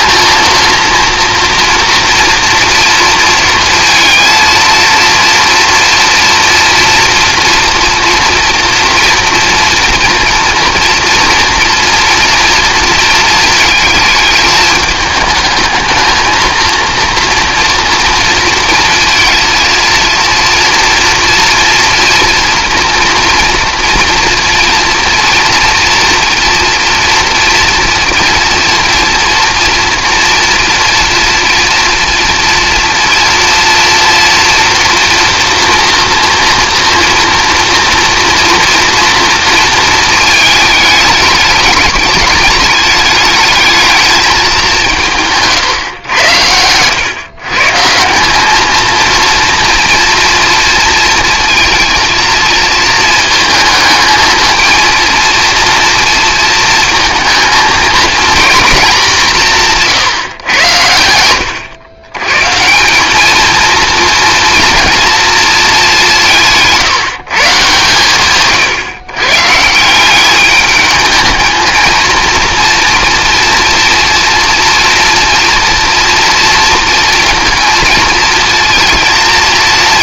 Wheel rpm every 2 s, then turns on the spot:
230, 240, 230, 230, 230, 230, 230, 210, 230, 230, 230, 230, 230, 240, 230, 230, 230, 240, 230, 230, 220, 210, 200, 110, 220, 230, 230, 230, 230, 210, 110, 180, 230, 160, 130, 210, 230, 230, 230, 230.
none